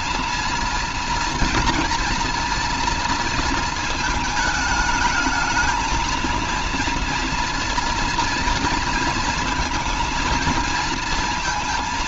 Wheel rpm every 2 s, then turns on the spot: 230, 230, 220, 230, 230, 220.
none